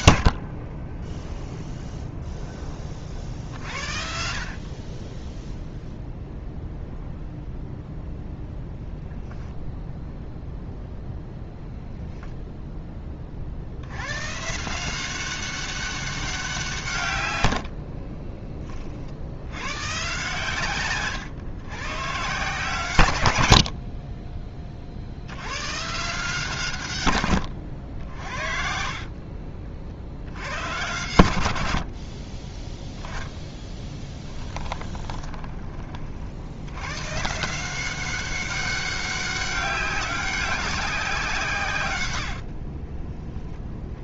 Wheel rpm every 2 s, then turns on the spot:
30, 20, 30, 0, 0, 0, 10, 170, 140, 40, 130, 140, 40, 140, 40, 100, 10, 20, 110, 200, 190, 40.
0-2 28-30 34-36 42-44